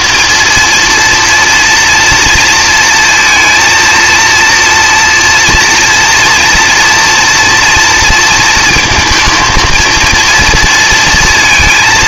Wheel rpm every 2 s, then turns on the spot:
230, 230, 230, 230, 220, 230.
none